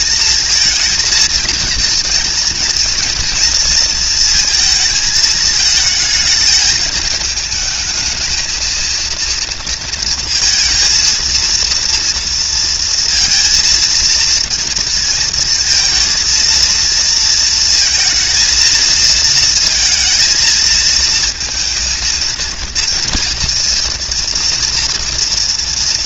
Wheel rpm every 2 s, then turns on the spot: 230, 230, 220, 220, 230, 230, 230, 230, 230, 230, 220, 230, 230.
none